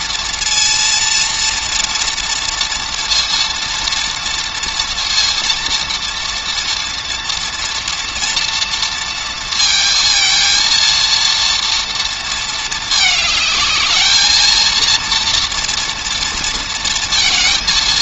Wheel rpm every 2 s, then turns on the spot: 230, 230, 230, 230, 230, 230, 220, 230, 230.
none